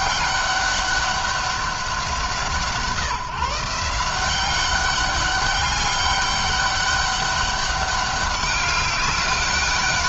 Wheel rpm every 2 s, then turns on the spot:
200, 180, 190, 200, 200.
none